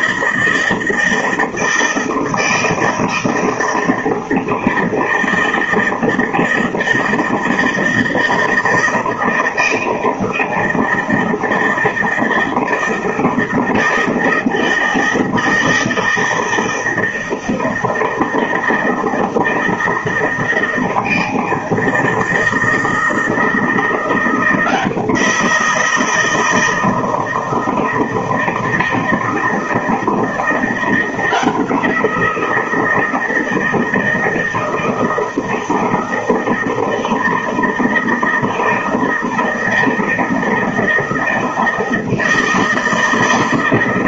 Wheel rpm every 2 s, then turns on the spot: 160, 160, 160, 160, 160, 160, 160, 160, 160, 160, 160, 160, 170, 160, 160, 170, 170, 160, 160, 160, 160, 160.
none